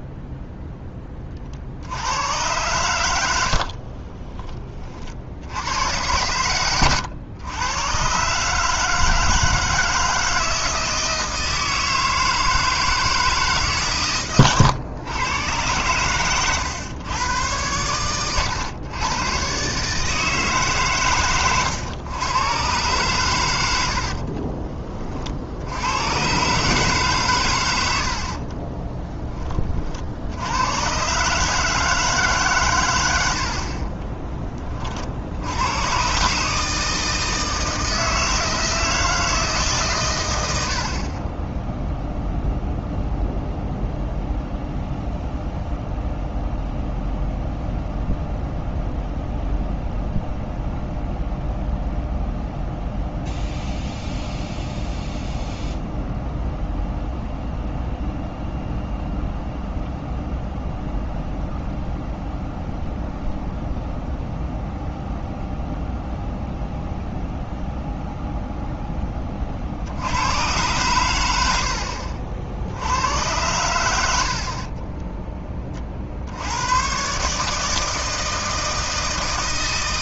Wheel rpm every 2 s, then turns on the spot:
10, 90, 50, 110, 160, 160, 160, 110, 110, 100, 140, 120, 30, 140, 30, 110, 130, 20, 160, 160, 70, 0, 0, 0, 0, 0, 0, 0, 0, 0, 0, 0, 0, 0, 0, 110, 70, 40, 100, 160.
28-30 74-76